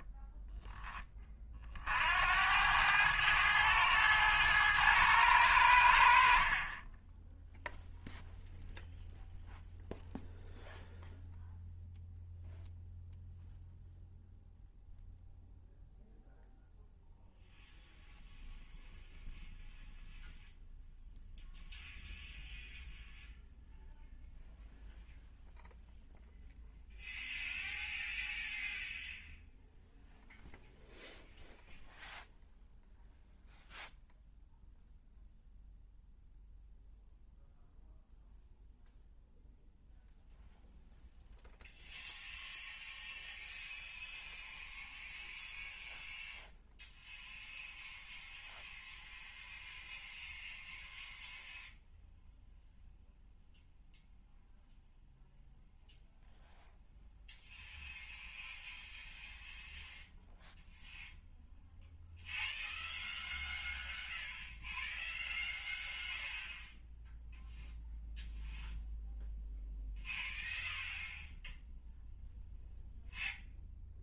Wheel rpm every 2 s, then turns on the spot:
10, 100, 110, 30, 0, 0, 0, 0, 0, 0, 0, 0, 0, 0, 0, 0, 0, 0, 0, 0, 0, 0, 0, 0, 0, 0, 0, 0, 0, 0, 0, 0, 0, 0, 0, 0, 0.
none